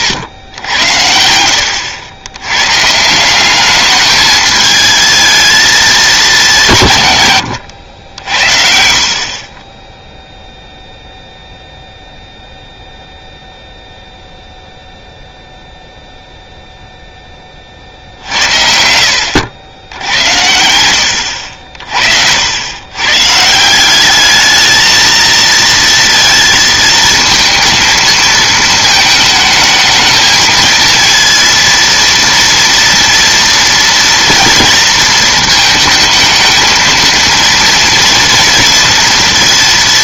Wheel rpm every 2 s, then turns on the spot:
90, 110, 220, 190, 70, 0, 0, 0, 0, 60, 80, 90, 220, 220, 220, 220, 230, 230, 220, 230.
none